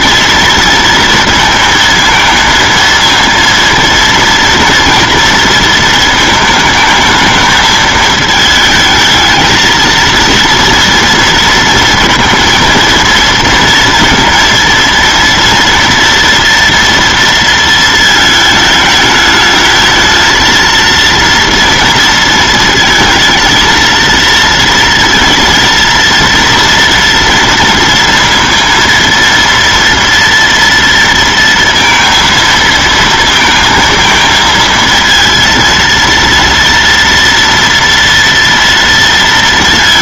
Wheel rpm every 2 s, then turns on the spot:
230, 220, 230, 220, 220, 230, 230, 230, 230, 220, 230, 220, 230, 230, 230, 230, 230, 230, 230, 230.
none